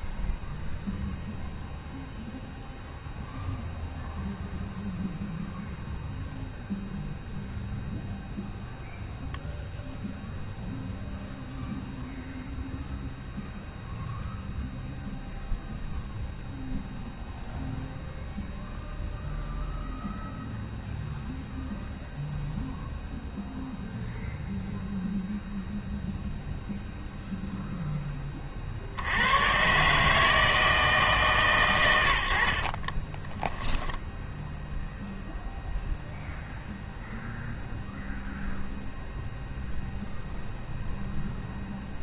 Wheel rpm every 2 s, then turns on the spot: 0, 0, 0, 0, 0, 0, 0, 0, 0, 0, 0, 0, 0, 0, 40, 160, 60, 0, 0, 0, 0.
32-34